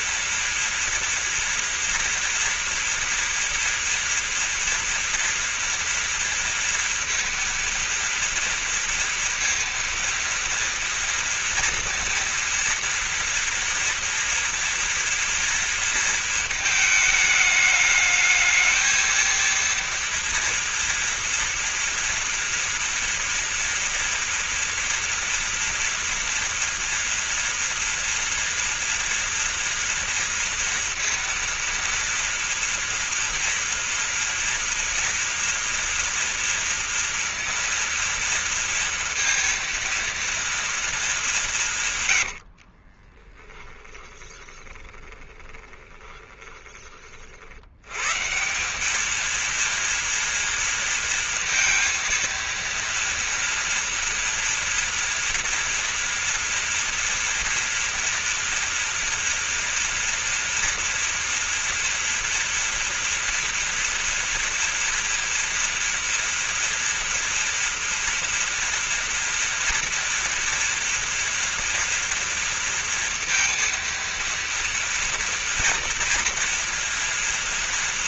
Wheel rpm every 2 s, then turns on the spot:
230, 230, 230, 230, 230, 230, 230, 240, 220, 220, 230, 230, 230, 240, 230, 230, 230, 230, 230, 230, 230, 40, 20, 30, 190, 230, 230, 230, 230, 230, 230, 230, 230, 230, 230, 230, 230, 230, 240.
42-46